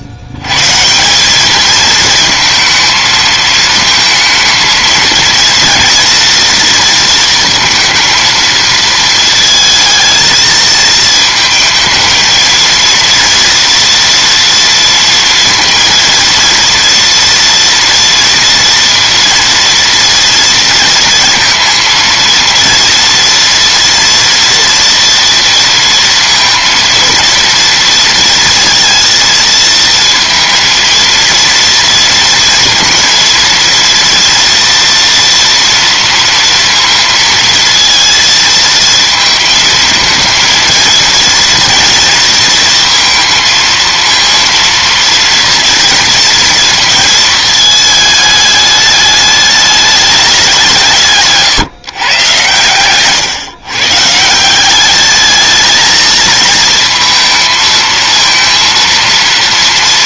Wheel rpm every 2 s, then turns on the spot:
170, 230, 220, 230, 220, 220, 230, 230, 230, 230, 230, 230, 240, 230, 230, 230, 230, 230, 230, 220, 230, 230, 230, 230, 210, 150, 130, 210, 220, 230.
none